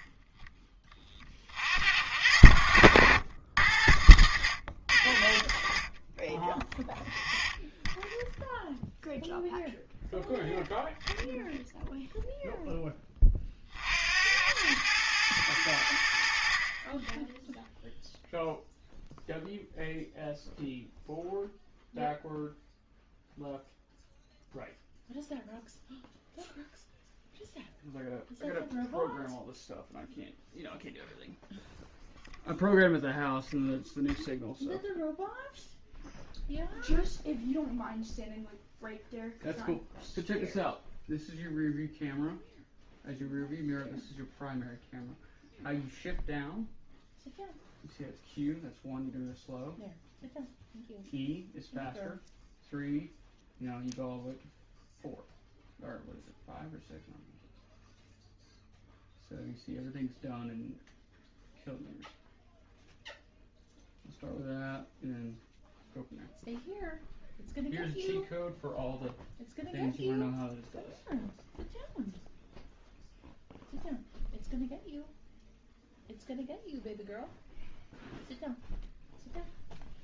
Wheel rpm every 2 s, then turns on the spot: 10, 80, 90, 10, 0, 0, 0, 90, 40, 0, 0, 0, 0, 0, 0, 0, 0, 0, 0, 0, 0, 0, 0, 0, 0, 0, 0, 0, 0, 0, 0, 0, 0, 0, 0, 0, 0, 0, 0, 0.
none